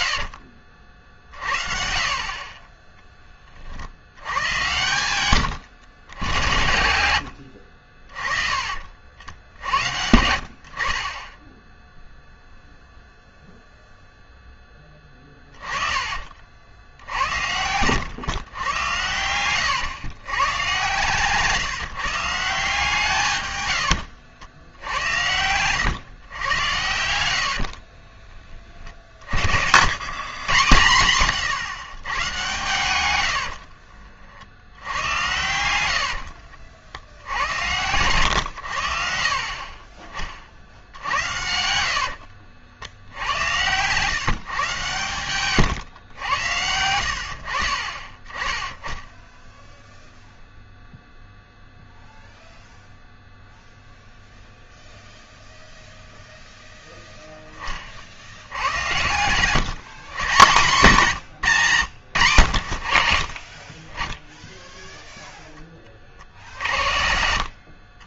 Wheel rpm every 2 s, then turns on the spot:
70, 30, 100, 90, 40, 50, 0, 10, 50, 110, 130, 160, 80, 100, 30, 120, 120, 60, 70, 90, 60, 70, 140, 90, 10, 0, 0, 0, 0, 90, 170, 90, 0, 50.
0-2 4-6 28-30 36-38 58-60 66-68